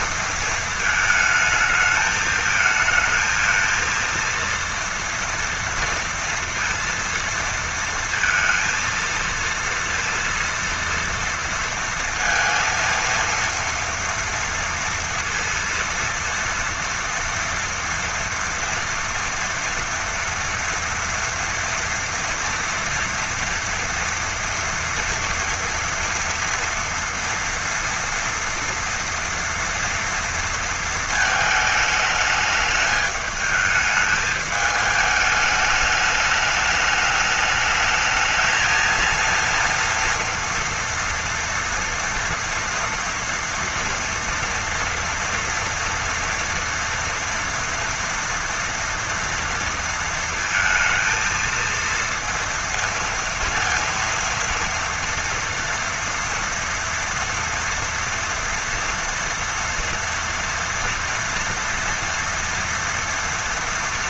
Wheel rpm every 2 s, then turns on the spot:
220, 220, 230, 230, 230, 230, 230, 230, 230, 230, 230, 230, 230, 230, 240, 230, 210, 210, 210, 220, 230, 230, 230, 240, 230, 230, 230, 230, 230, 230, 230, 230.
none